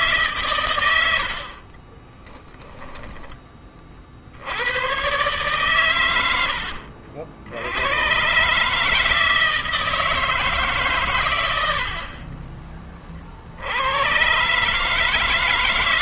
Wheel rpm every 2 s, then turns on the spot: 110, 10, 100, 70, 150, 140, 30, 140.
none